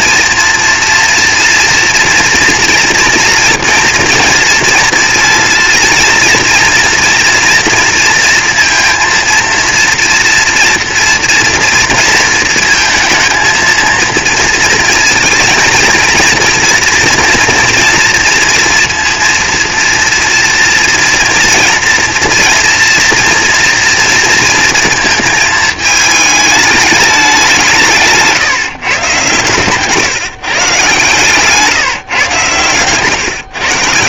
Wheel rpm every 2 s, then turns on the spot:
230, 230, 230, 230, 230, 230, 230, 230, 230, 230, 230, 230, 240, 210, 150, 150, 140.
none